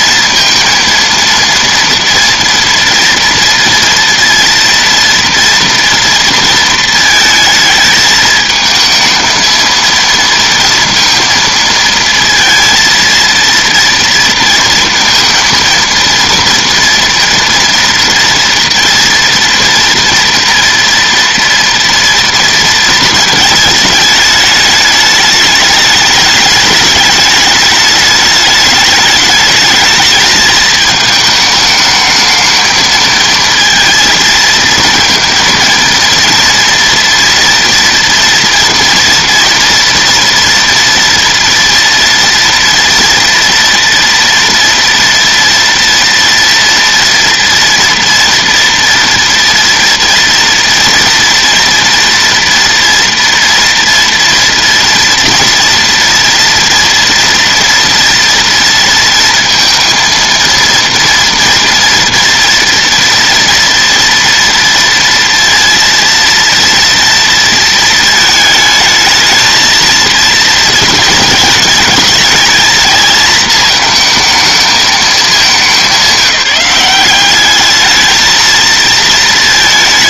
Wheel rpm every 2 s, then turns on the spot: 230, 240, 230, 220, 220, 230, 230, 230, 230, 230, 230, 220, 210, 210, 210, 220, 220, 230, 230, 230, 230, 230, 230, 240, 230, 230, 230, 230, 240, 230, 230, 230, 230, 230, 220, 230, 220, 220, 200, 230.
none